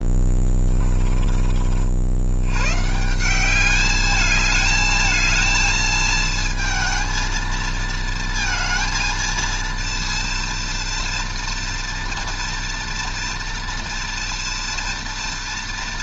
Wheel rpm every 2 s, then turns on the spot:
10, 120, 220, 230, 230, 230, 230, 230.
0-2